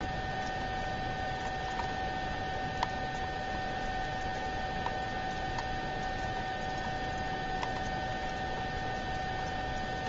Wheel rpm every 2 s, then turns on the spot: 0, 0, 0, 0, 0.
none